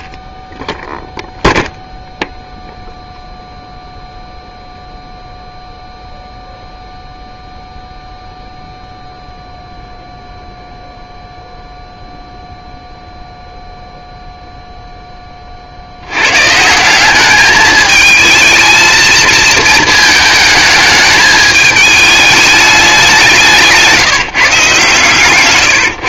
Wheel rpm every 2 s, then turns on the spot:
0, 0, 0, 0, 0, 0, 0, 40, 210, 230, 210, 170, 150.
22-24